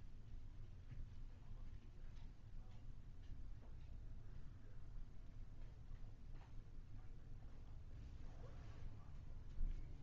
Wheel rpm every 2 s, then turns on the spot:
0, 0, 0, 0, 0.
none